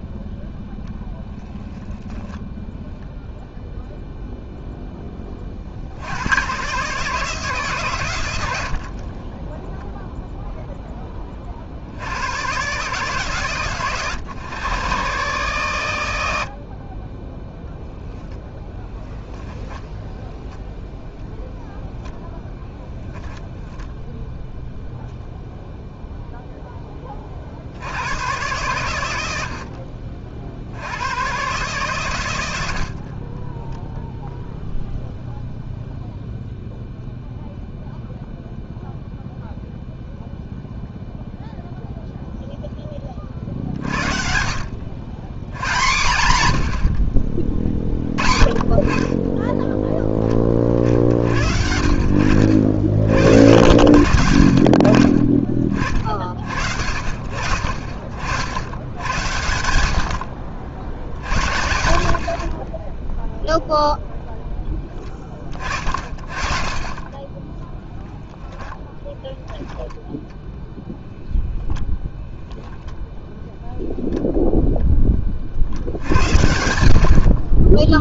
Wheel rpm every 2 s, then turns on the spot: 0, 0, 20, 140, 20, 20, 140, 130, 20, 10, 10, 10, 0, 20, 90, 110, 30, 0, 0, 0, 0, 20, 100, 70, 30, 50, 70, 40, 60, 80, 80, 30, 10, 40, 10, 0, 0, 0, 70.
none